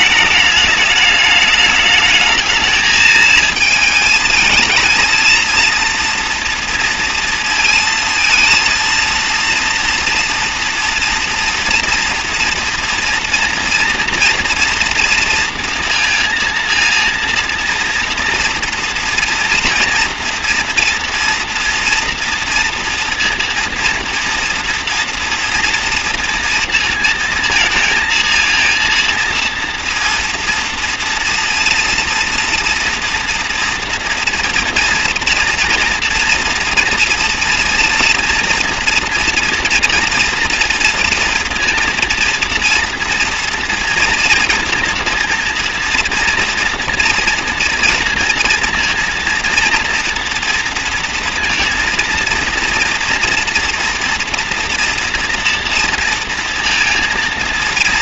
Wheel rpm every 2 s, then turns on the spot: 220, 220, 220, 230, 230, 240, 230, 230, 230, 230, 230, 230, 230, 230, 230, 230, 230, 230, 230, 230, 230, 230, 240, 230, 240, 230, 230, 240, 230.
none